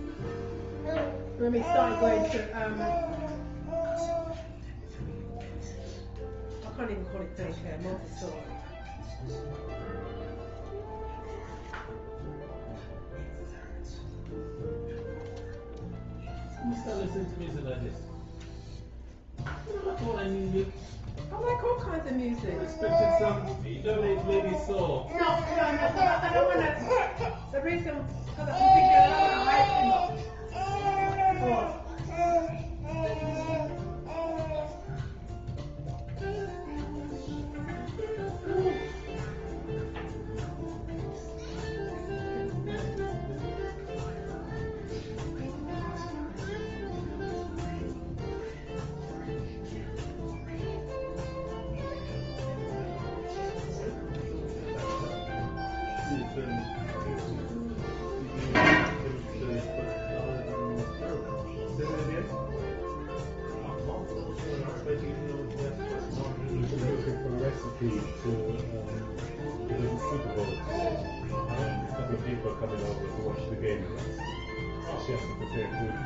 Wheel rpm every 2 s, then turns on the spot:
0, 0, 0, 0, 0, 0, 0, 0, 0, 0, 0, 0, 0, 0, 0, 0, 0, 0, 0, 0, 0, 0, 0, 0, 0, 0, 0, 0, 0, 0, 0, 0, 0, 0, 0, 0, 0, 0.
none